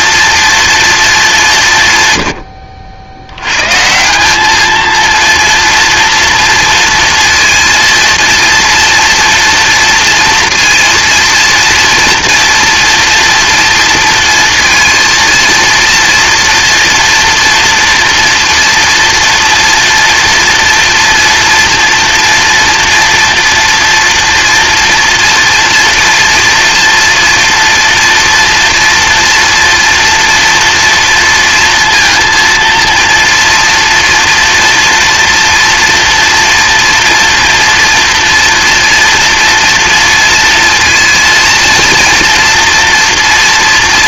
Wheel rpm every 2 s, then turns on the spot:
230, 80, 220, 230, 230, 230, 240, 230, 230, 230, 230, 230, 230, 230, 230, 230, 230, 230, 230, 240, 230, 230.
none